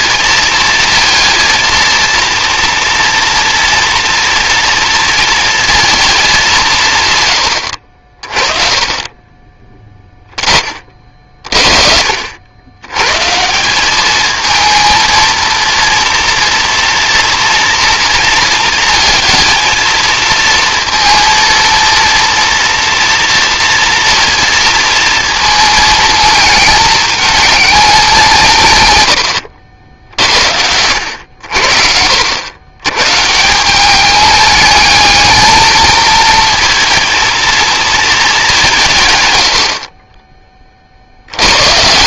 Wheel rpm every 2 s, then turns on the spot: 230, 230, 230, 180, 30, 30, 100, 220, 230, 230, 230, 230, 230, 220, 140, 70, 100, 220, 230, 160, 50.
none